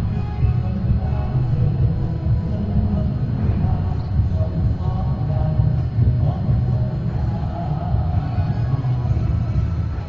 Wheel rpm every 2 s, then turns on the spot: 0, 0, 0, 0, 0.
none